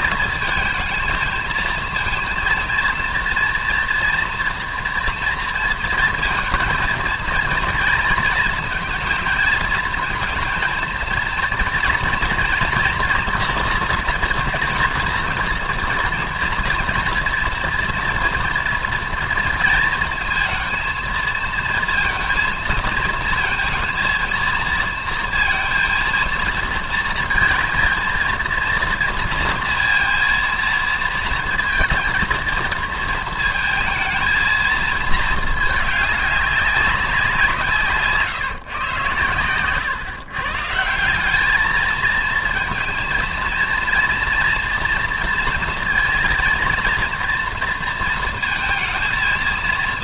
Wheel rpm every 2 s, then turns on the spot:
220, 230, 230, 230, 230, 230, 240, 230, 230, 230, 230, 230, 230, 230, 230, 230, 220, 220, 190, 120, 160, 230, 240, 230, 220.
none